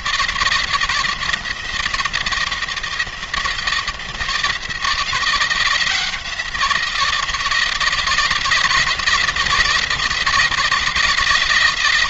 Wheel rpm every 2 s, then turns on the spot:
170, 170, 170, 170, 170, 160.
none